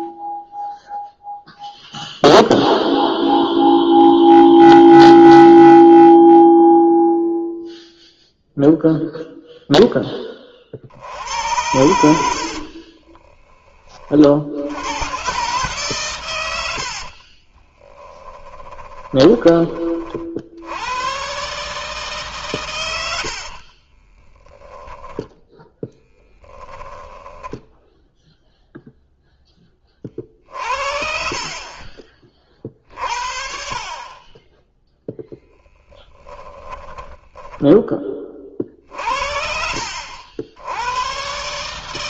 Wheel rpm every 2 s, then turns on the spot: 0, 0, 0, 0, 0, 50, 40, 100, 70, 20, 90, 100, 20, 10, 0, 50, 50, 10, 20, 50, 110.
12-14 16-20 24-28 36-38